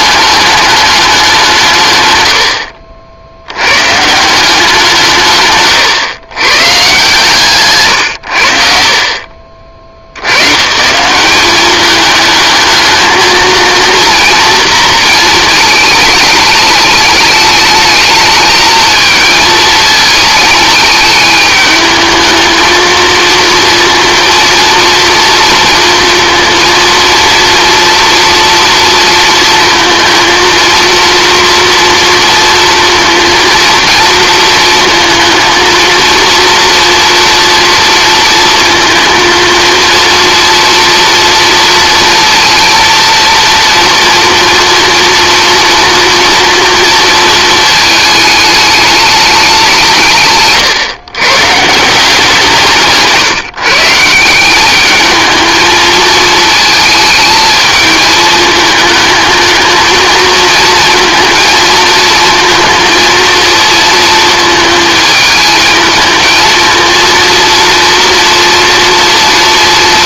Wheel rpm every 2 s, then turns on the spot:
210, 60, 170, 130, 60, 140, 220, 230, 210, 220, 220, 220, 230, 230, 230, 230, 230, 220, 230, 230, 230, 230, 230, 230, 210, 130, 160, 190, 220, 220, 230, 230, 220, 220, 240.
none